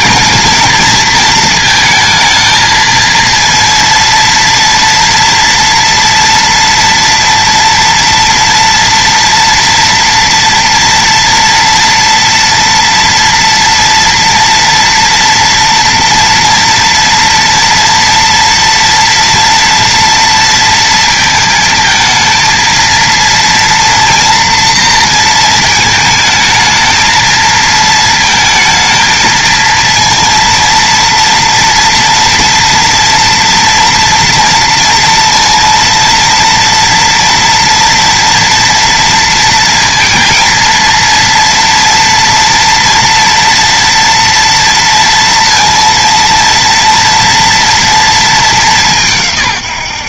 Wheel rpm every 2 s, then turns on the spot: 230, 230, 230, 240, 240, 230, 230, 230, 230, 240, 220, 230, 230, 220, 230, 230, 230, 230, 240, 230, 230, 230, 230, 230, 180.
none